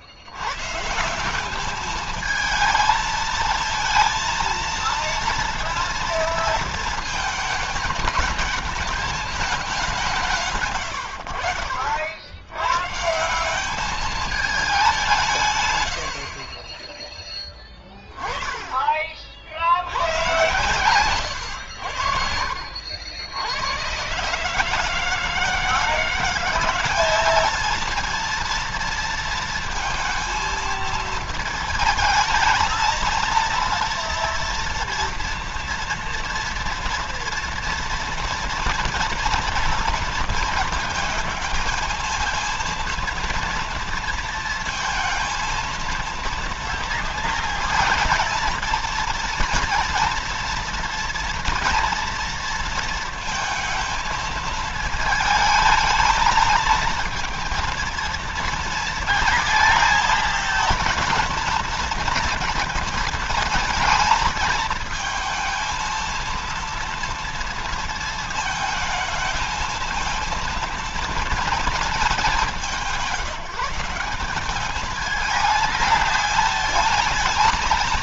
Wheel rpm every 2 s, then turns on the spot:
110, 220, 230, 230, 210, 150, 110, 210, 30, 20, 110, 70, 150, 180, 230, 230, 220, 230, 230, 230, 230, 230, 230, 230, 230, 230, 230, 220, 220, 230, 230, 230, 220, 230, 220, 230, 190, 200, 220.
none